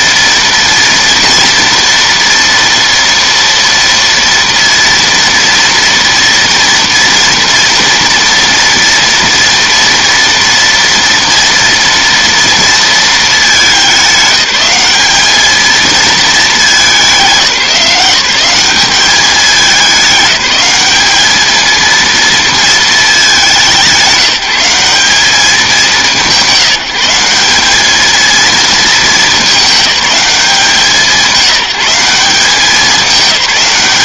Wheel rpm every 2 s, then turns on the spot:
230, 230, 230, 230, 230, 230, 220, 210, 190, 200, 210, 210, 200, 180, 220, 190, 210.
none